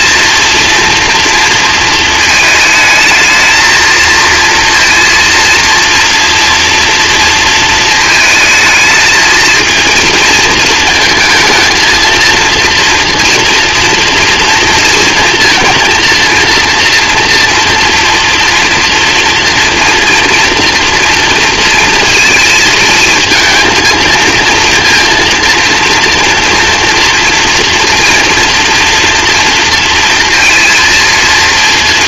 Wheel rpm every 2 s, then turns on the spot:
230, 220, 230, 230, 220, 230, 230, 230, 230, 240, 230, 230, 230, 230, 230, 230.
none